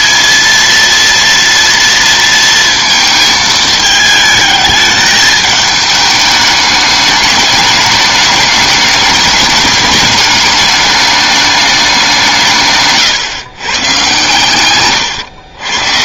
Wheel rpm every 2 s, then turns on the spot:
230, 230, 220, 210, 210, 210, 150, 130.
none